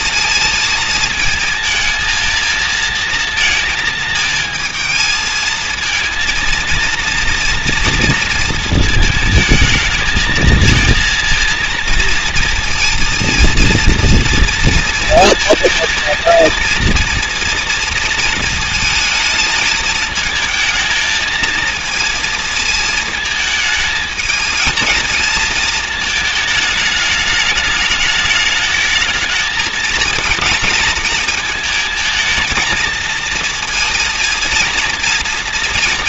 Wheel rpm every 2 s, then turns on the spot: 230, 230, 220, 230, 220, 220, 230, 230, 230, 230, 220, 220, 220, 220, 220, 230, 230, 230.
none